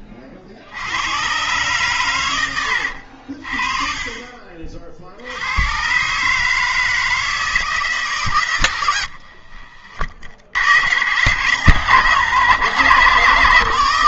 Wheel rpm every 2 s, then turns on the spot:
70, 90, 50, 160, 110, 90, 150.
2-4